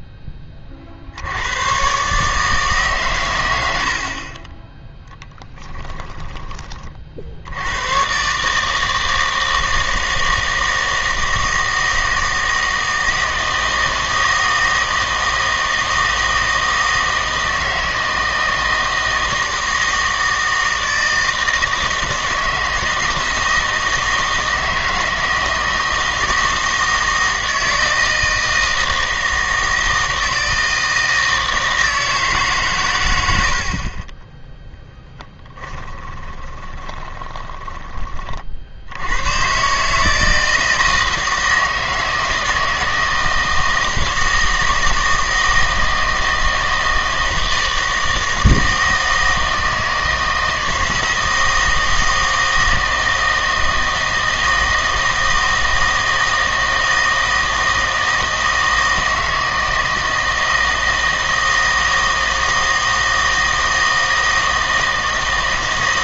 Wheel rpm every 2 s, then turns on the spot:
40, 140, 10, 30, 160, 160, 160, 160, 160, 160, 160, 160, 160, 160, 160, 160, 130, 10, 20, 60, 160, 160, 160, 160, 160, 160, 160, 160, 160, 160, 160, 160, 160.
36-38